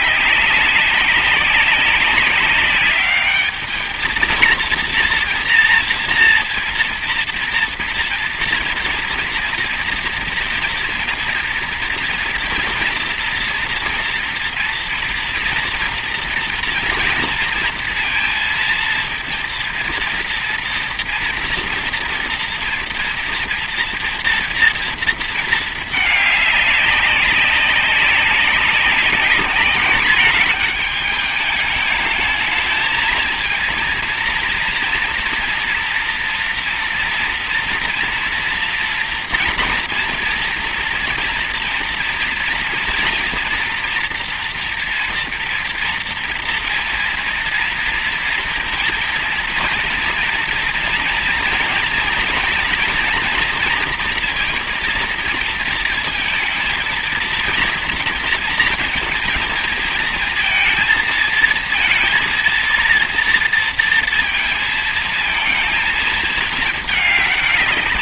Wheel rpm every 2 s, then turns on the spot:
190, 200, 230, 230, 230, 230, 230, 230, 230, 230, 230, 230, 230, 200, 200, 210, 230, 230, 230, 230, 230, 230, 230, 230, 230, 230, 240, 230, 230, 230, 230, 230, 220, 210.
none